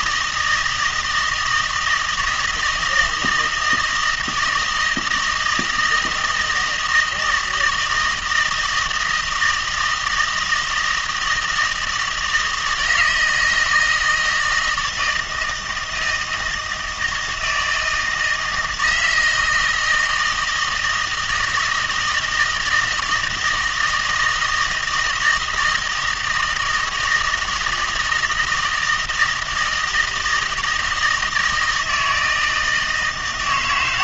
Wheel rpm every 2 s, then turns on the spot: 160, 160, 160, 160, 160, 160, 160, 160, 160, 160, 160, 160, 160, 160, 160, 160, 160.
none